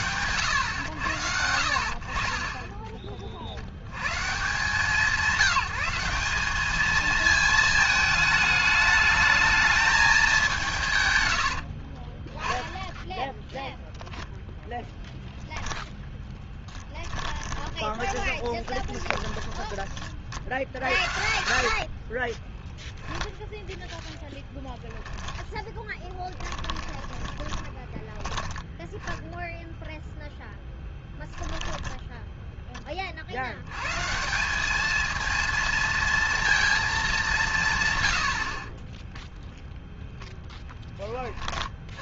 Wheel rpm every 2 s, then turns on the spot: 100, 30, 180, 220, 210, 130, 10, 0, 10, 20, 60, 10, 10, 10, 10, 10, 10, 200, 220, 30, 10.
16-24 26-28 30-32 38-40